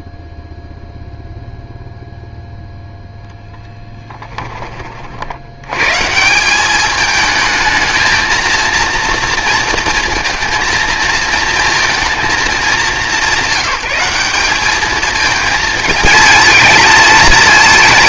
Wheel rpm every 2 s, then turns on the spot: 0, 0, 30, 200, 230, 230, 220, 210, 220.
none